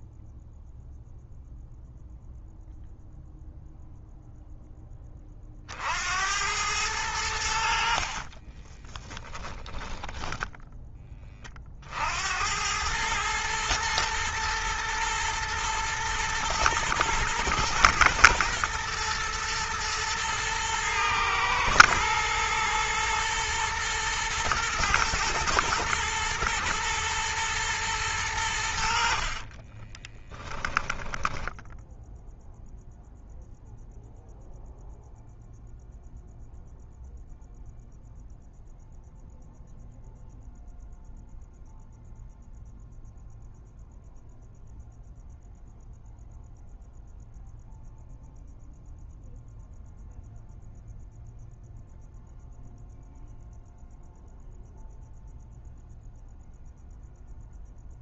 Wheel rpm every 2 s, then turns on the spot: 0, 0, 0, 90, 40, 10, 90, 110, 110, 120, 120, 120, 120, 120, 90, 10, 0, 0, 0, 0, 0, 0, 0, 0, 0, 0, 0, 0, 0.
8-12 30-32